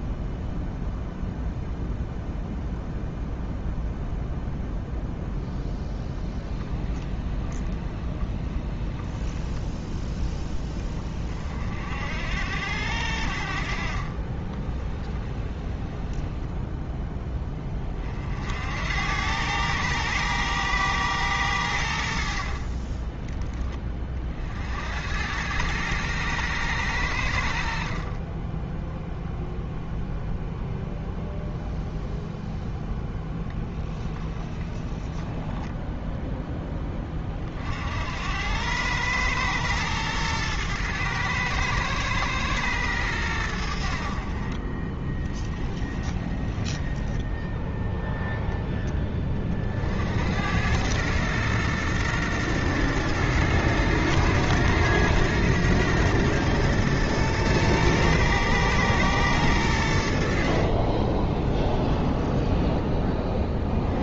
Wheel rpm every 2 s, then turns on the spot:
0, 0, 0, 10, 20, 10, 70, 20, 10, 70, 110, 50, 60, 110, 10, 0, 0, 20, 10, 100, 110, 110, 20, 10, 0, 90, 110, 110, 120, 110, 40, 10.
6-10 14-18 22-24 28-30 34-36 44-48 60-62